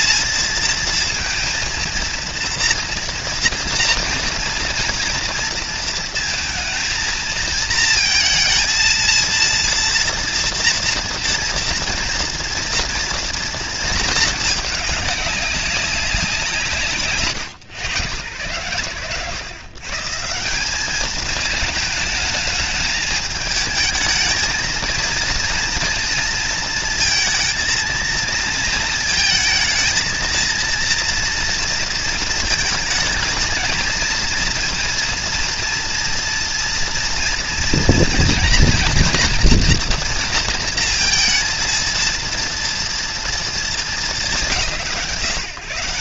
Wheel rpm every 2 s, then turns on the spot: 220, 230, 230, 230, 230, 230, 240, 210, 150, 120, 190, 210, 230, 230, 230, 230, 220, 230, 230, 240, 230, 230, 200.
none